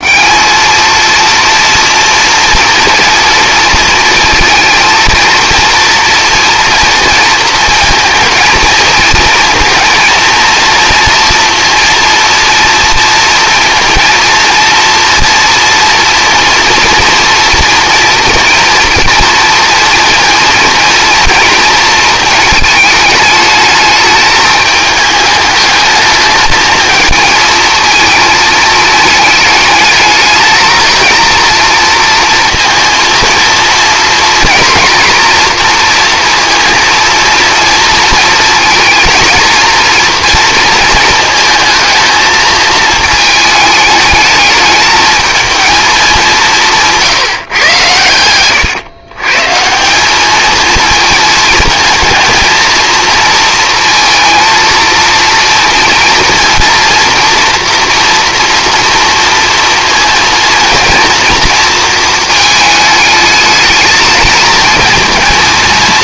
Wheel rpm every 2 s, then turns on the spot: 210, 230, 230, 230, 230, 230, 230, 230, 230, 230, 230, 220, 220, 220, 220, 220, 230, 230, 230, 230, 230, 220, 220, 180, 120, 220, 230, 230, 240, 240, 230, 210, 220.
none